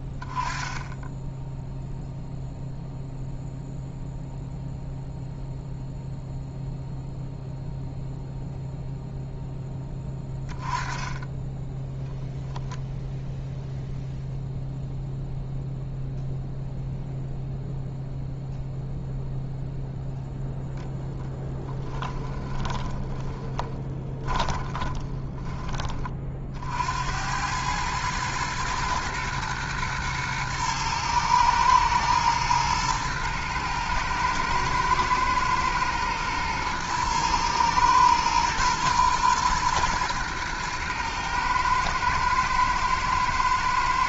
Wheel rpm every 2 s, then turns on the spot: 20, 0, 0, 0, 0, 10, 0, 0, 0, 0, 0, 20, 20, 70, 110, 110, 110, 110, 110, 120, 110, 110.
22-26